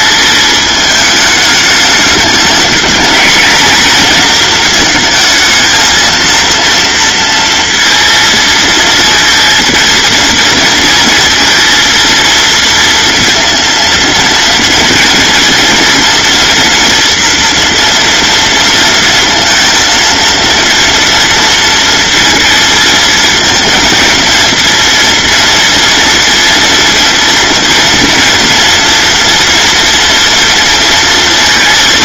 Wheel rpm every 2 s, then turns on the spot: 220, 210, 230, 230, 230, 230, 230, 230, 230, 230, 230, 230, 230, 230, 230, 230.
none